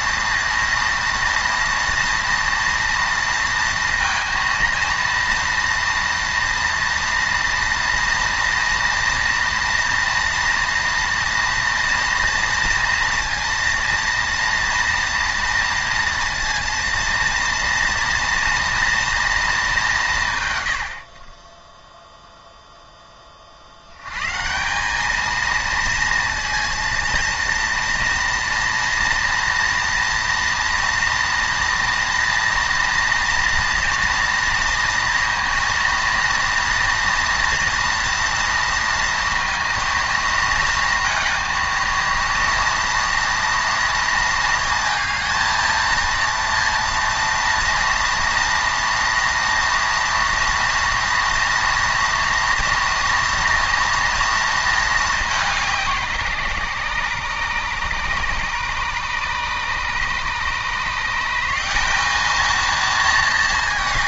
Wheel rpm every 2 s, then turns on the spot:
230, 230, 230, 240, 230, 230, 230, 240, 230, 230, 80, 10, 190, 230, 230, 230, 230, 230, 230, 230, 230, 230, 230, 230, 230, 230, 240, 220, 140, 140, 160, 220.
none